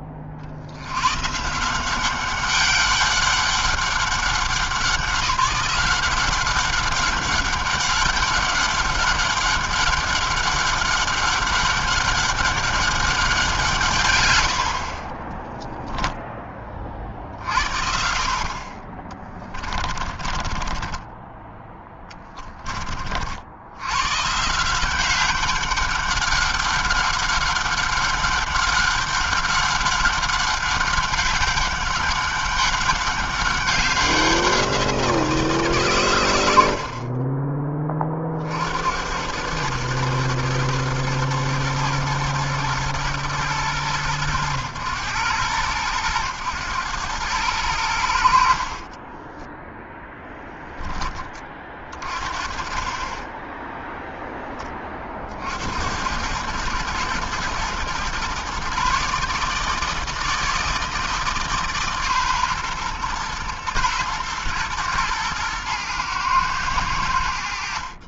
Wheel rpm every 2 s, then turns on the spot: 130, 200, 180, 200, 200, 200, 190, 30, 40, 20, 20, 50, 190, 200, 200, 200, 190, 170, 40, 90, 110, 110, 100, 110, 30, 10, 20, 40, 110, 140, 160, 120, 110, 90.
14-16 18-22 48-50